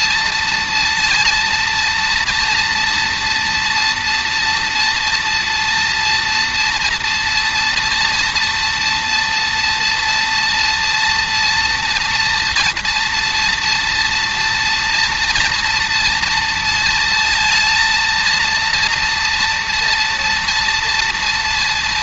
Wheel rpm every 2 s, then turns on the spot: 230, 240, 230, 230, 230, 230, 230, 230, 230, 230, 230.
none